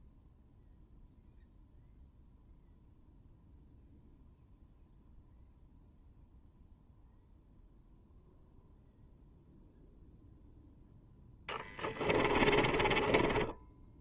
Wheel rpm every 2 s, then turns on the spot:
0, 0, 0, 0, 0, 0, 20.
12-14